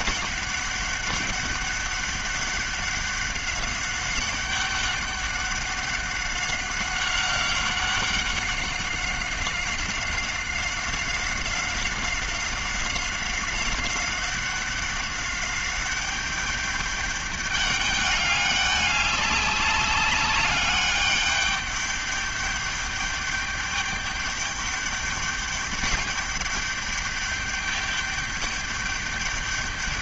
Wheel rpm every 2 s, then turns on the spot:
200, 200, 190, 190, 190, 190, 190, 190, 200, 200, 200, 210, 200, 200, 200.
none